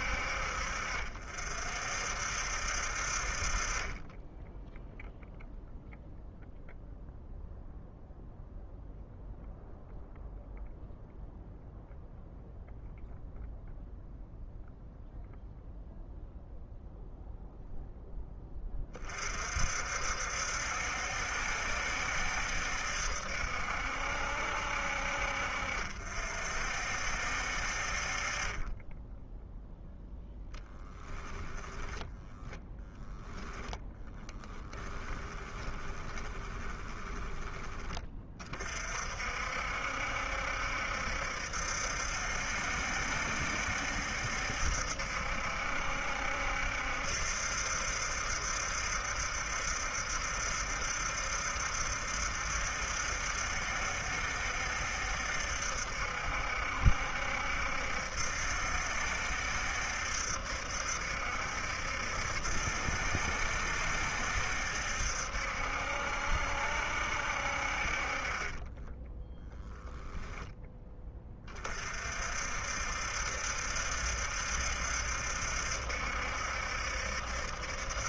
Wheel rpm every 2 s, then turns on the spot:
50, 50, 0, 0, 0, 0, 0, 0, 0, 30, 70, 70, 60, 60, 10, 10, 10, 20, 20, 50, 70, 70, 70, 70, 70, 70, 70, 70, 70, 70, 70, 70, 70, 70, 10, 20, 70, 70, 70.
30-38 68-70